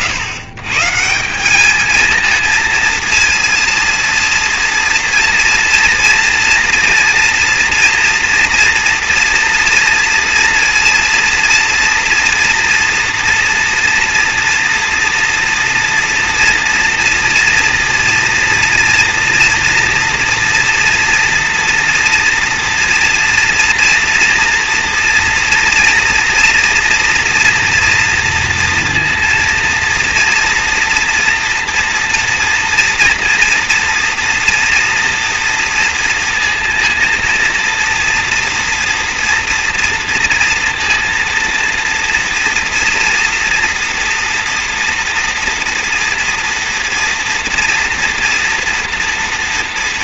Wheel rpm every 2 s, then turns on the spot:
150, 220, 230, 230, 230, 230, 230, 230, 230, 230, 240, 240, 230, 230, 230, 230, 230, 230, 230, 240, 230, 230, 230, 230, 240.
none